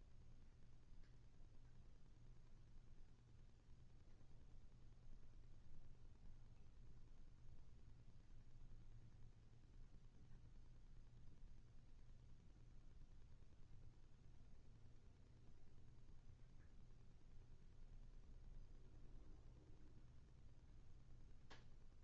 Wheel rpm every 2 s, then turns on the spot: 0, 0, 0, 0, 0, 0, 0, 0, 0, 0, 0.
none